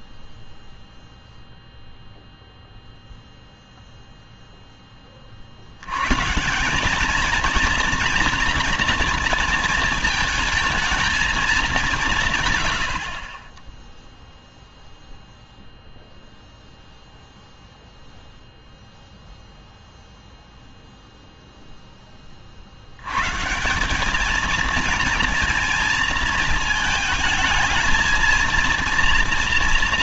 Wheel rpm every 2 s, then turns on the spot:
0, 0, 0, 180, 230, 220, 110, 0, 0, 0, 0, 40, 220, 230, 230.
none